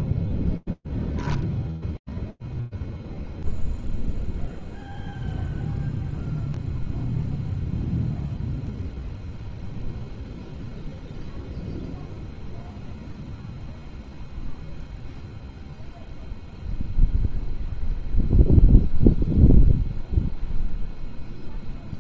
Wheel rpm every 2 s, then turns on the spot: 0, 0, 0, 0, 0, 0, 0, 0, 0, 0, 0.
none